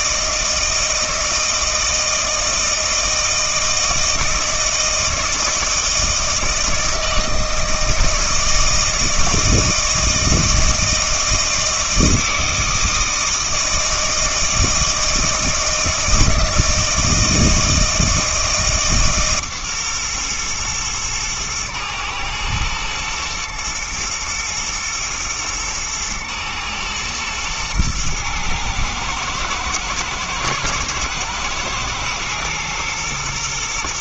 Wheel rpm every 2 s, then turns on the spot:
160, 160, 160, 160, 160, 160, 160, 160, 160, 150, 110, 110, 120, 120, 110, 120, 120.
none